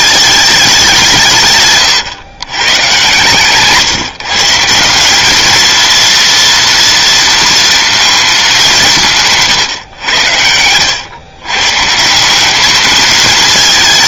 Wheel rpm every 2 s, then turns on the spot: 210, 120, 170, 230, 200, 90, 200.
none